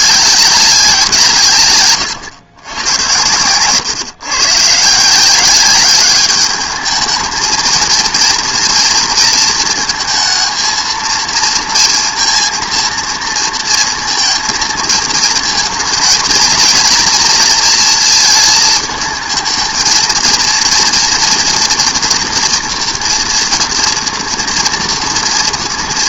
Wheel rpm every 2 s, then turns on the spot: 200, 100, 130, 210, 230, 220, 230, 220, 230, 220, 230, 240, 230.
none